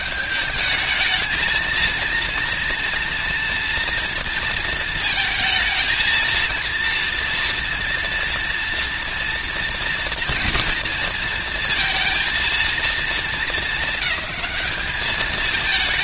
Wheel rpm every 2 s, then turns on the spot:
210, 230, 230, 230, 230, 230, 230, 210.
none